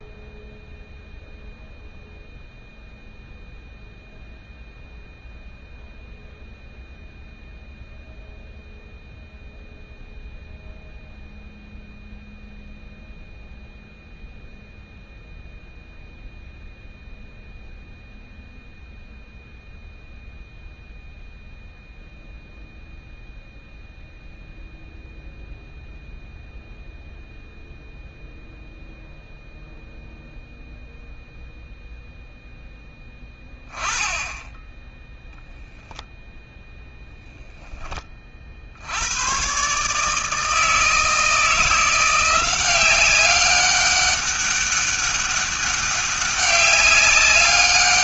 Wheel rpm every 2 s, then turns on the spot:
0, 0, 0, 0, 0, 0, 0, 0, 0, 0, 0, 0, 0, 0, 0, 0, 10, 10, 0, 70, 160, 190, 200, 200.
none